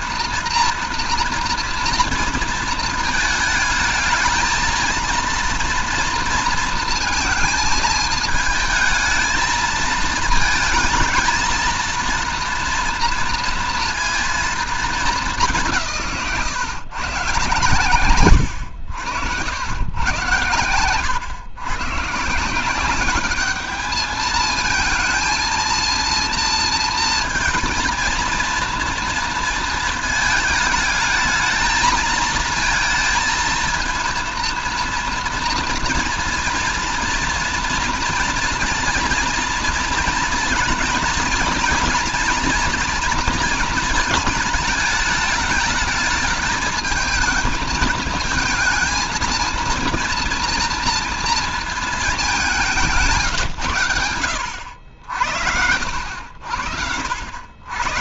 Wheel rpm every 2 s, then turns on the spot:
230, 230, 220, 230, 220, 220, 230, 220, 140, 100, 110, 170, 220, 230, 230, 220, 220, 230, 230, 230, 230, 230, 220, 220, 220, 230, 190, 70, 70.
none